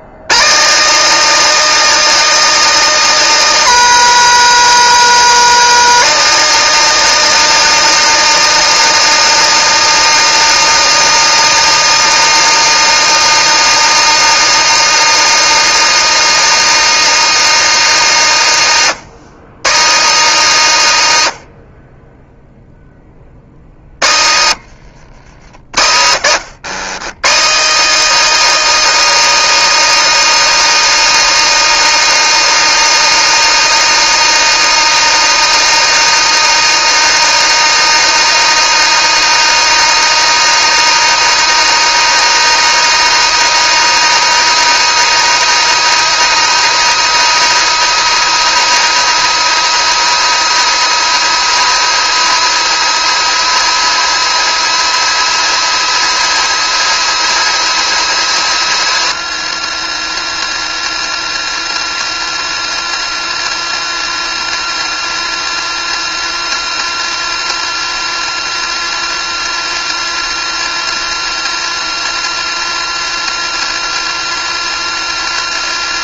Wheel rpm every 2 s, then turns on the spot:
180, 280, 270, 280, 280, 280, 280, 280, 280, 200, 220, 0, 120, 150, 330, 340, 340, 310, 320, 340, 340, 320, 340, 340, 350, 340, 350, 350, 350, 350, 360, 360, 360, 360, 360, 360, 360, 360.
24-26